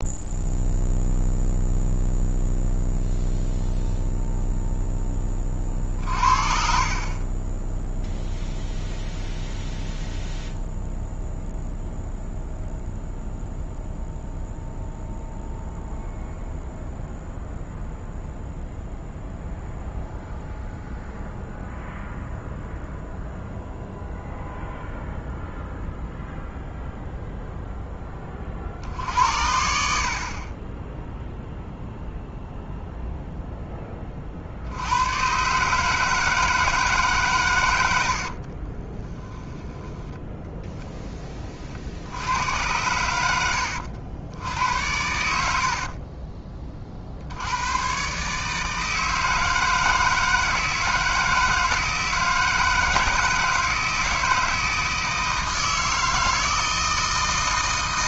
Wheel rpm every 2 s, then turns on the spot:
0, 0, 0, 50, 0, 0, 0, 0, 0, 0, 0, 0, 0, 0, 50, 20, 0, 70, 160, 30, 0, 100, 90, 30, 150, 160, 160, 160, 160.
38-40